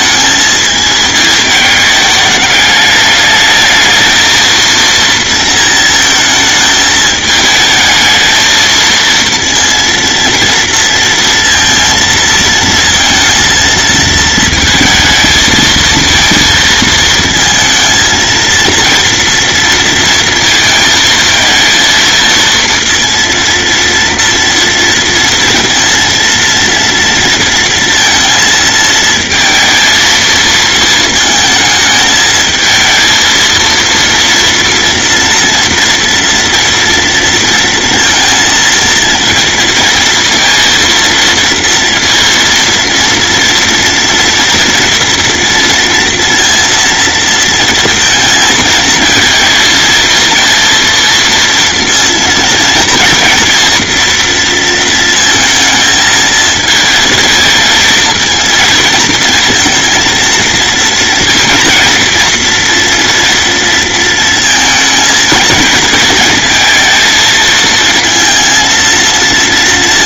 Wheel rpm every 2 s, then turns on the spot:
220, 210, 230, 220, 220, 230, 230, 230, 220, 230, 230, 230, 230, 230, 230, 220, 220, 230, 230, 230, 230, 230, 240, 230, 220, 230, 230, 230, 220, 230, 230, 240, 220, 220, 220.
none